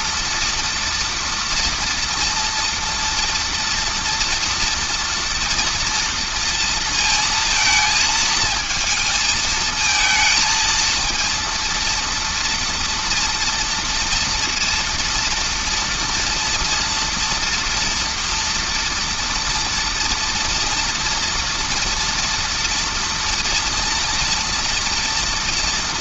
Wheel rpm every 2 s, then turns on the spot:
230, 230, 230, 230, 220, 230, 230, 230, 230, 240, 230, 230, 230.
none